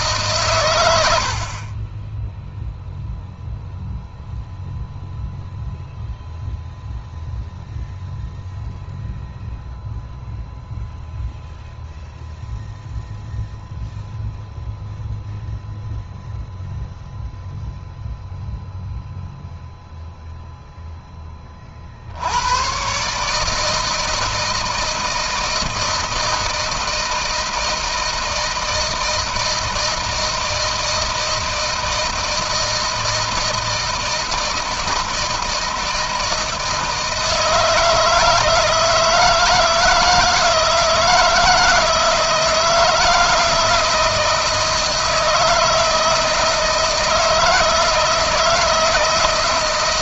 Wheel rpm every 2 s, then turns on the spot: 140, 10, 0, 0, 0, 0, 0, 0, 0, 0, 0, 90, 160, 160, 160, 160, 160, 160, 160, 160, 160, 160, 160, 160, 160.
none